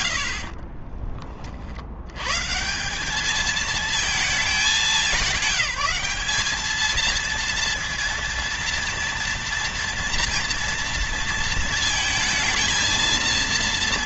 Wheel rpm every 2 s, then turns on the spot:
50, 150, 210, 210, 230, 230, 230.
0-2